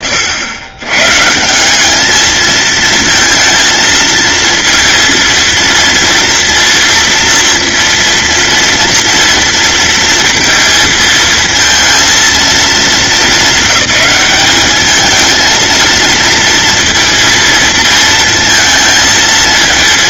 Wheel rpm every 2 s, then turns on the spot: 120, 230, 230, 230, 230, 220, 220, 210, 230, 230.
none